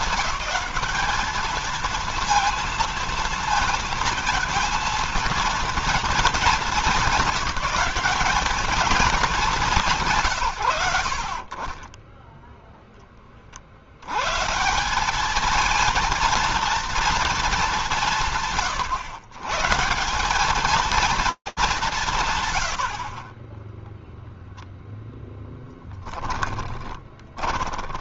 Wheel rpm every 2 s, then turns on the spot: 210, 230, 230, 200, 200, 130, 0, 130, 230, 160, 210, 50, 0, 10.
26-28